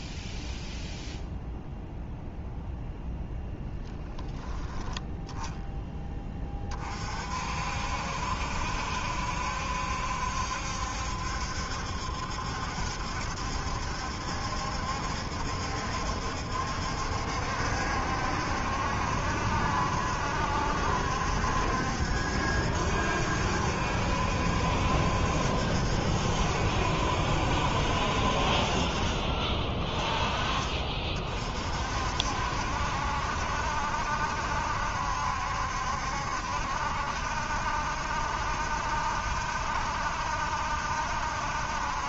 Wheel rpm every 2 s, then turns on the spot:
0, 0, 0, 40, 70, 70, 70, 70, 70, 70, 70, 70, 70, 70, 30, 40, 70, 70, 70, 70, 70.
none